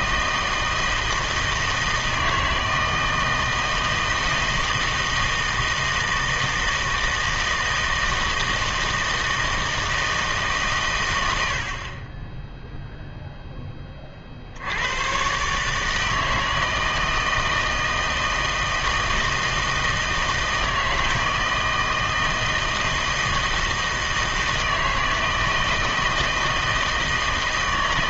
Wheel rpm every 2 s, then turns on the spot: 160, 160, 160, 160, 160, 140, 0, 70, 160, 160, 160, 160, 160, 160.
none